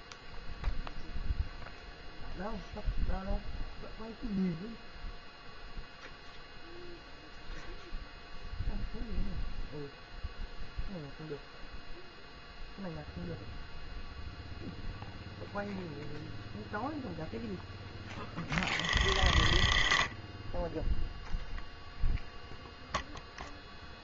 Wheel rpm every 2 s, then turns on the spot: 0, 0, 0, 0, 0, 0, 0, 0, 0, 30, 10, 0.
none